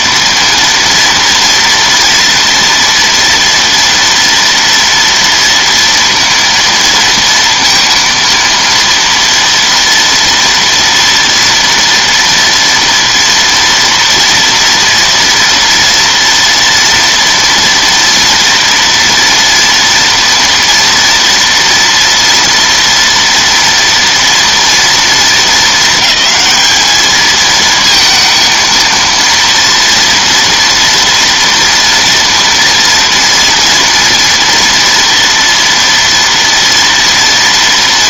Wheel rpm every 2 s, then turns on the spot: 230, 240, 230, 230, 230, 230, 230, 240, 230, 230, 230, 230, 220, 220, 230, 240, 230, 230, 230.
none